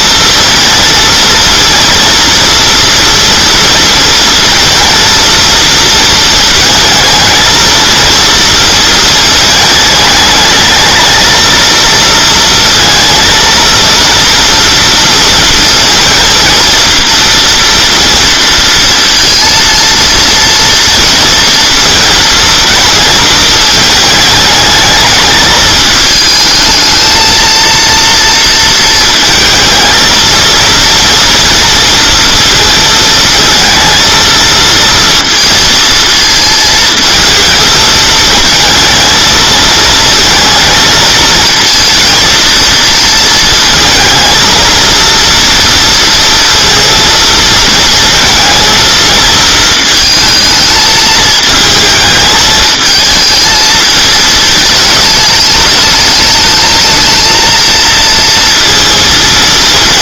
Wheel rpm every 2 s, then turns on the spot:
230, 230, 230, 230, 230, 210, 230, 230, 230, 230, 230, 220, 210, 220, 230, 230, 230, 230, 220, 230, 230, 230, 230, 230, 230, 220, 220, 220, 220, 230.
none